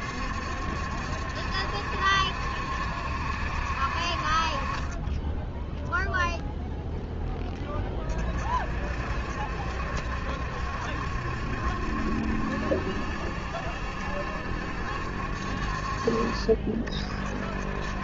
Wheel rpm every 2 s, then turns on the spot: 70, 70, 40, 0, 50, 70, 70, 70, 50.
none